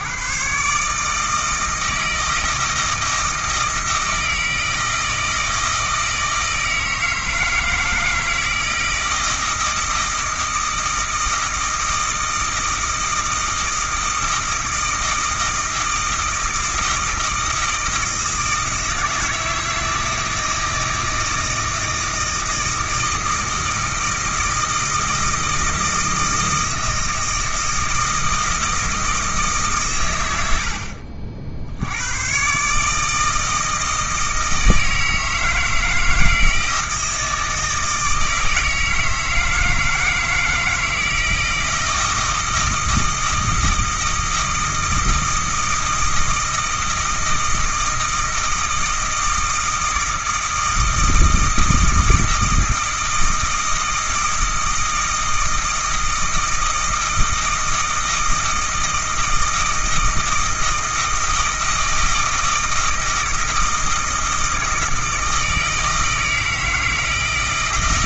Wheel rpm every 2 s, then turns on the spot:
120, 160, 160, 160, 160, 160, 160, 160, 160, 160, 160, 160, 160, 160, 160, 70, 140, 160, 160, 160, 160, 160, 160, 160, 160, 160, 160, 160, 160, 160, 160, 160, 160, 160.
none